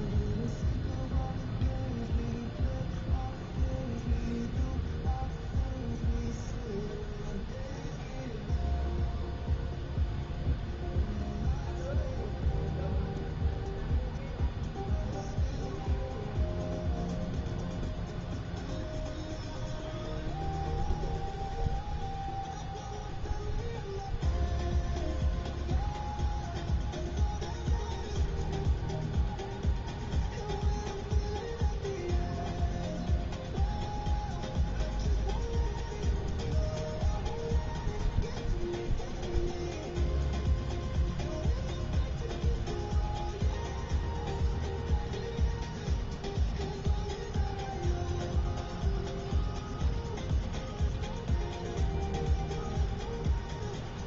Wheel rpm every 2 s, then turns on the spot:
0, 0, 0, 0, 0, 0, 0, 0, 0, 0, 0, 0, 0, 0, 0, 0, 0, 0, 0, 0, 0, 0, 0, 0, 0, 0, 0.
none